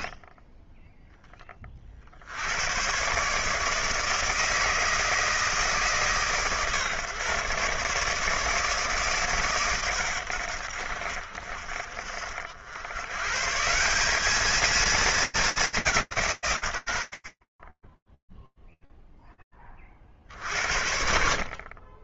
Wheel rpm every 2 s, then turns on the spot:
0, 80, 160, 150, 150, 80, 50, 200, 120, 0, 60.
none